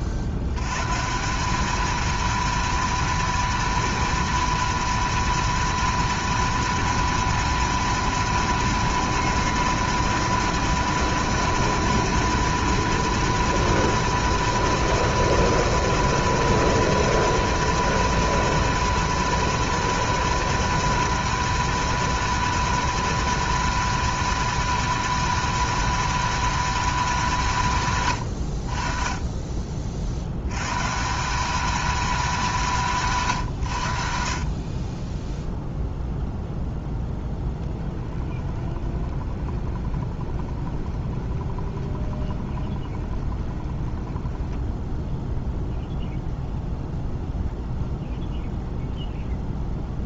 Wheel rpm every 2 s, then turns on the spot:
120, 230, 230, 230, 230, 230, 230, 230, 240, 230, 240, 240, 240, 230, 50, 130, 180, 30, 0, 20, 20, 20, 10, 0, 0.
38-46